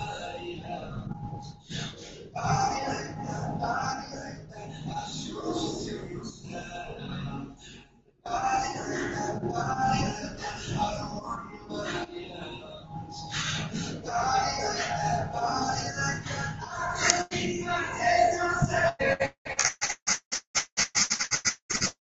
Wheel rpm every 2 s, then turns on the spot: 0, 0, 0, 0, 0, 0, 0, 0, 0, 20, 0.
18-20